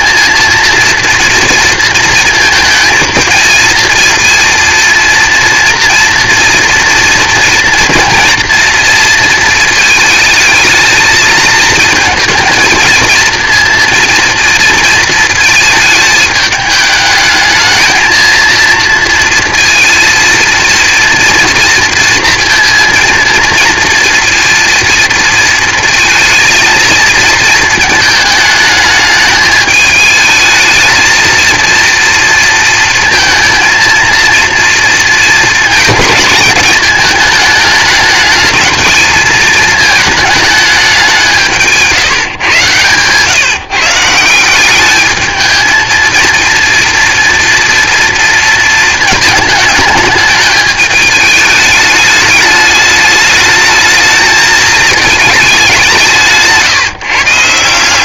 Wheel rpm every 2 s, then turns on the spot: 230, 230, 230, 230, 230, 220, 230, 230, 210, 230, 230, 230, 230, 230, 210, 220, 230, 230, 220, 220, 200, 130, 200, 230, 220, 210, 210, 220, 150.
none